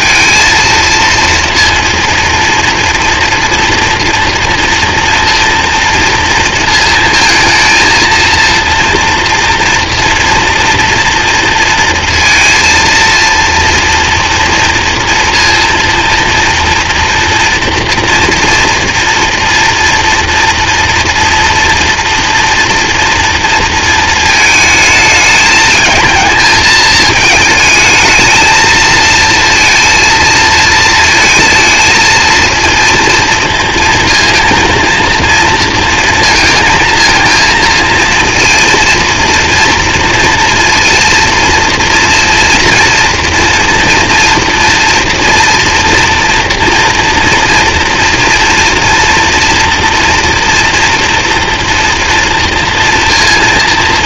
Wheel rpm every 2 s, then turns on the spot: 230, 230, 240, 230, 230, 230, 230, 230, 230, 230, 230, 230, 220, 220, 230, 220, 230, 230, 230, 230, 230, 240, 230, 230, 230, 230, 230.
none